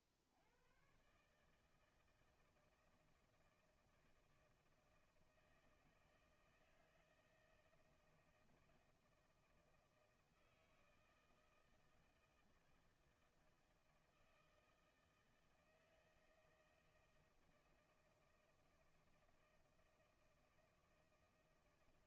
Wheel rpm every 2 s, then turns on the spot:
70, 160, 160, 160, 160, 160, 160, 160, 160, 160, 160.
none